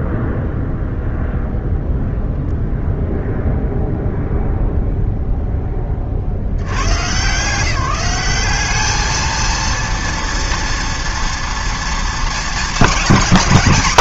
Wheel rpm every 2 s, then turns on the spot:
0, 0, 70, 200, 230, 220, 260.
none